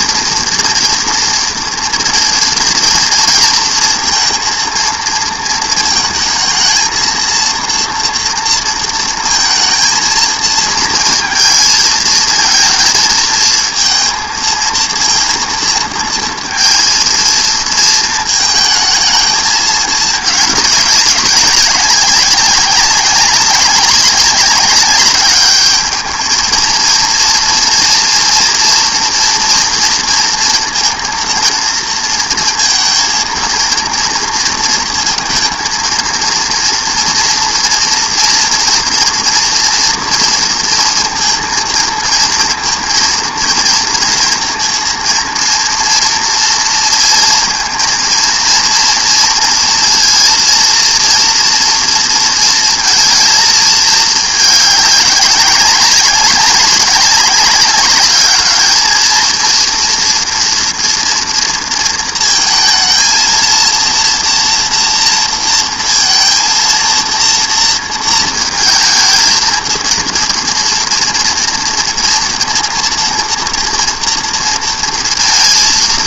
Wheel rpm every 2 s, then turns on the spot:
230, 230, 230, 220, 230, 230, 230, 230, 230, 220, 200, 200, 200, 220, 240, 230, 230, 230, 230, 230, 230, 230, 230, 230, 230, 230, 230, 210, 200, 220, 230, 230, 230, 230, 220, 230, 230, 230.
none